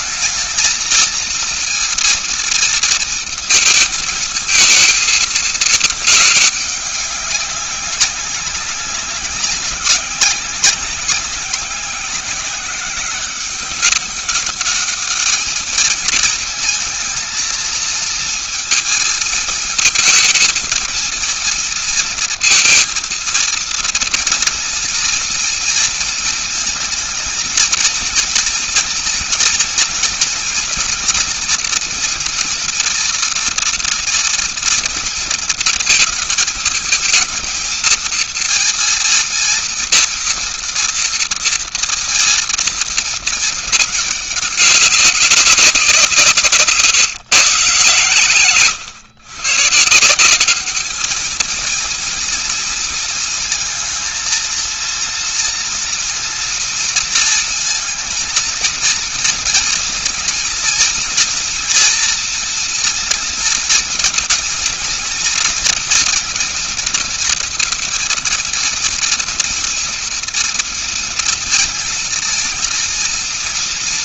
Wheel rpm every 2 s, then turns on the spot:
220, 230, 220, 210, 190, 190, 190, 200, 220, 220, 230, 230, 230, 220, 230, 230, 230, 230, 220, 230, 230, 230, 200, 160, 140, 190, 230, 230, 230, 230, 240, 240, 230, 230, 230, 240, 230.
none